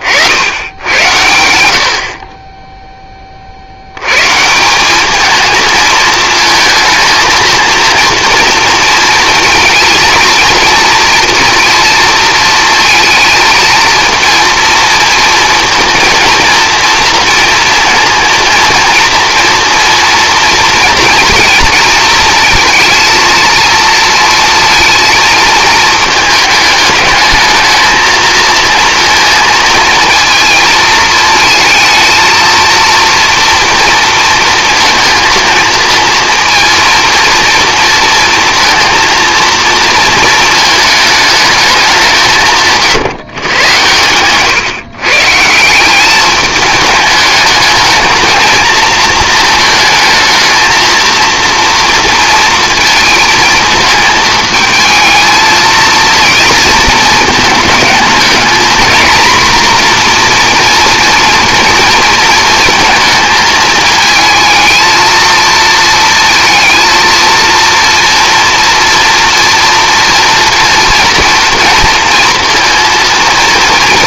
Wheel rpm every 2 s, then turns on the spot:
90, 10, 190, 220, 230, 230, 220, 230, 230, 230, 230, 230, 230, 210, 220, 220, 230, 230, 230, 230, 220, 140, 140, 210, 230, 230, 230, 220, 230, 240, 230, 220, 230, 230, 230, 230, 230.
none